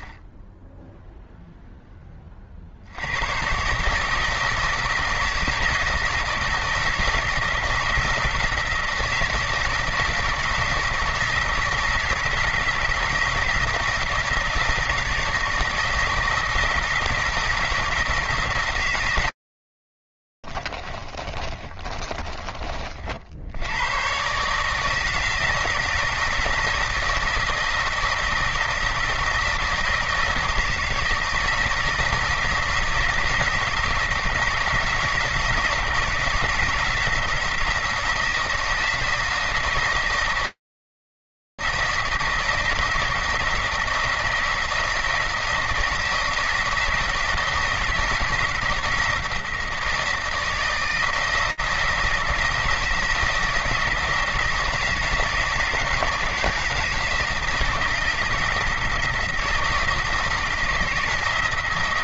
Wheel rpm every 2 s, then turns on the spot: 0, 30, 160, 160, 160, 160, 170, 160, 160, 160, 50, 30, 130, 160, 170, 170, 170, 160, 170, 160, 160, 160, 170, 160, 170, 160, 160, 160, 160, 160, 160.
20-22